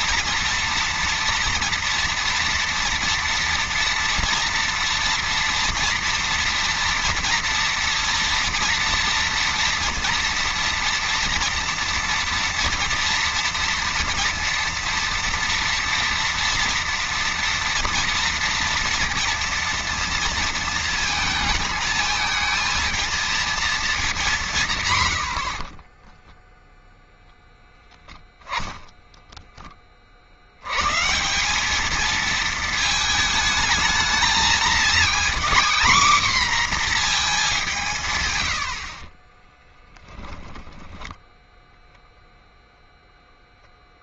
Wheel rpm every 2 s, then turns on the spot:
230, 230, 230, 230, 230, 230, 240, 230, 230, 230, 230, 230, 120, 0, 0, 140, 220, 240, 240, 60, 10, 10.
38-40